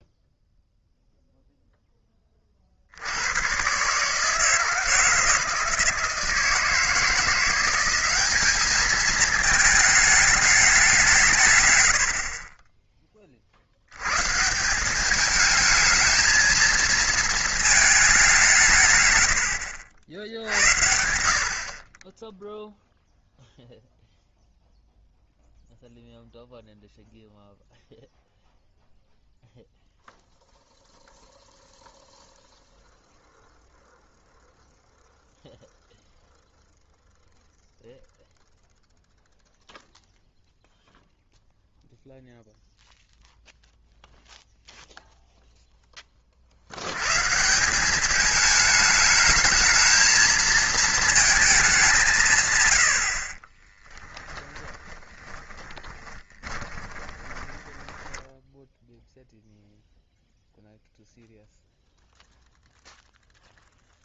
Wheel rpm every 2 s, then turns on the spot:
0, 50, 160, 170, 210, 200, 30, 170, 230, 150, 70, 0, 0, 0, 0, 0, 0, 0, 0, 0, 0, 0, 0, 80, 210, 220, 110, 20, 20, 10, 0, 0.
54-58